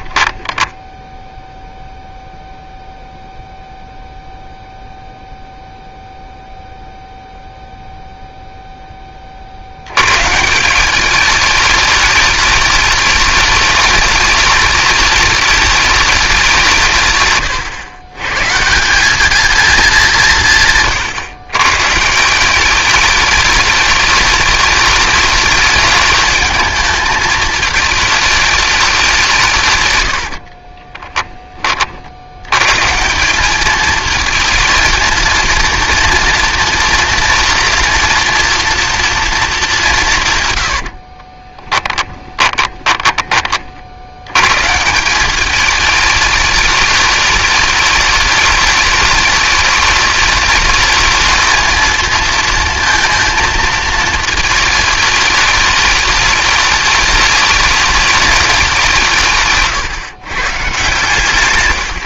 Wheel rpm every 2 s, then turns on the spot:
10, 0, 0, 0, 10, 170, 210, 210, 150, 180, 130, 200, 210, 220, 200, 20, 130, 230, 230, 230, 90, 20, 140, 210, 210, 210, 230, 220, 210, 190, 130.
30-32 40-44